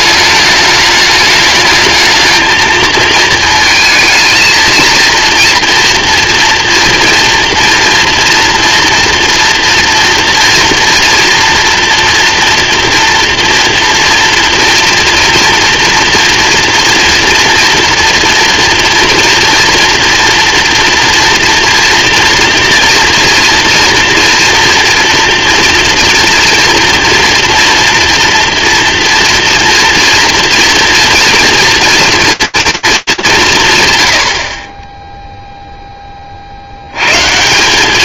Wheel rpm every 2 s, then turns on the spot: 210, 220, 230, 230, 230, 230, 230, 230, 240, 230, 230, 230, 230, 230, 230, 230, 230, 60, 60.
none